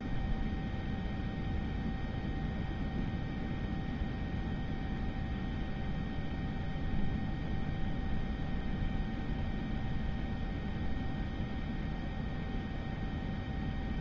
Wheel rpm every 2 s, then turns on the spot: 0, 0, 0, 0, 0, 0, 0.
none